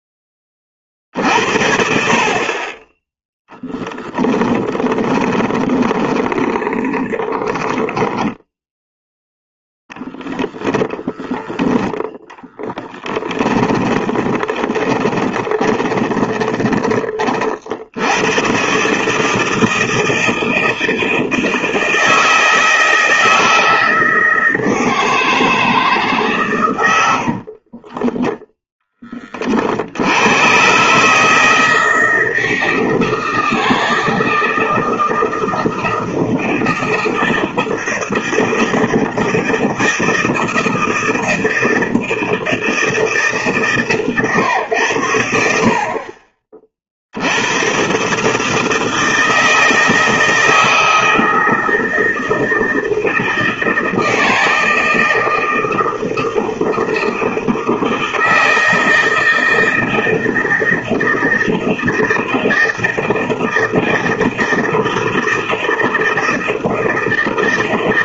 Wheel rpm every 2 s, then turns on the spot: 10, 50, 10, 20, 10, 10, 20, 20, 20, 110, 160, 160, 160, 130, 10, 120, 160, 160, 160, 160, 160, 160, 110, 40, 160, 160, 160, 160, 160, 160, 160, 160, 160, 160.
4-10 12-16